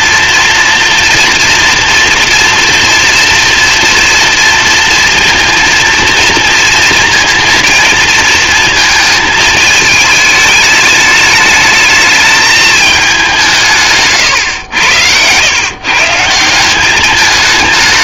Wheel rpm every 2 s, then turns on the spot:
230, 240, 230, 230, 220, 210, 210, 100, 190.
none